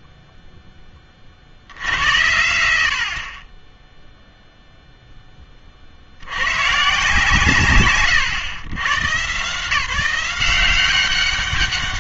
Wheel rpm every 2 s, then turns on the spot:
0, 70, 0, 120, 120, 180.
none